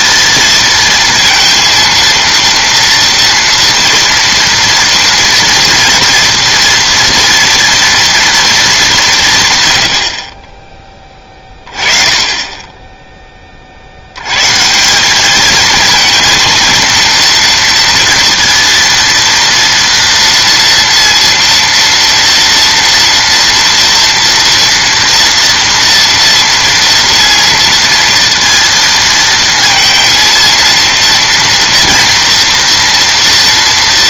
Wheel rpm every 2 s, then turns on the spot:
230, 230, 230, 230, 210, 10, 10, 160, 230, 230, 230, 230, 230, 230, 230, 230, 240.
none